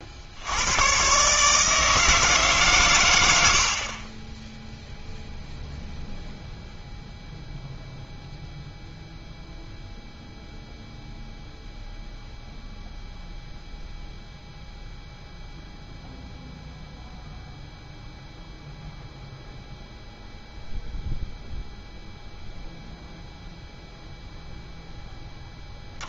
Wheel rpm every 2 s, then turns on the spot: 120, 120, 0, 0, 0, 0, 0, 0, 0, 0, 0, 0, 10.
none